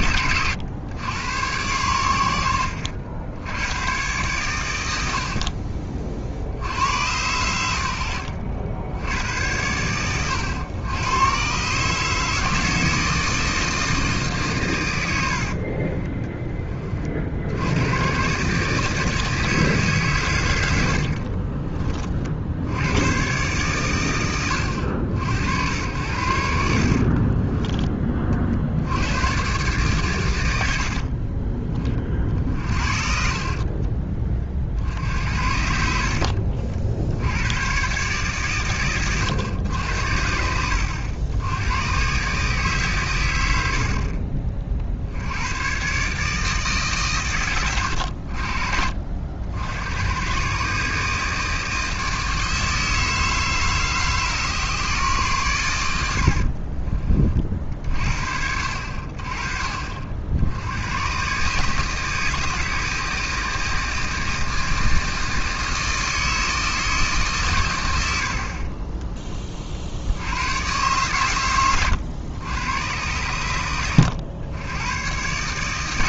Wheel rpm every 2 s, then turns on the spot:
100, 80, 100, 80, 90, 100, 160, 120, 30, 150, 80, 80, 110, 60, 80, 80, 50, 50, 60, 120, 80, 130, 60, 150, 50, 130, 160, 140, 40, 60, 90, 160, 160, 160, 30, 120, 110, 100.
2-4 20-22 26-28 32-34